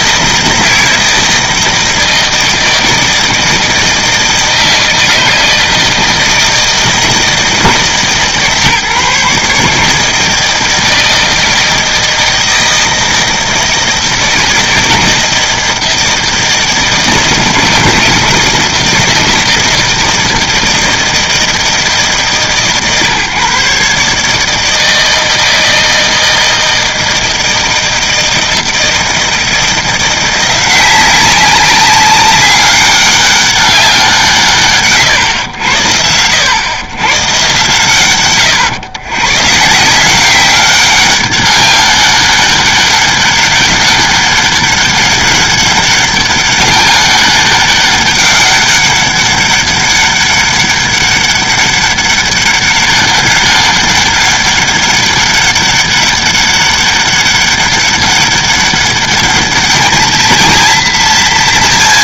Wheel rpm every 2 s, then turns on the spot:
160, 160, 160, 160, 150, 160, 160, 160, 160, 160, 160, 140, 160, 160, 160, 180, 200, 140, 100, 130, 190, 200, 200, 200, 200, 200, 200, 200, 200, 200, 230.
none